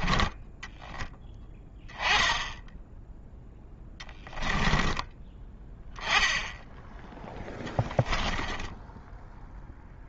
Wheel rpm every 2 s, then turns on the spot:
10, 0, 10, 10, 10.
8-10